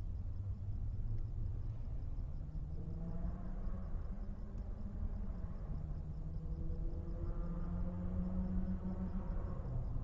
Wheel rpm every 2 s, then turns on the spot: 0, 0, 0, 0, 0.
none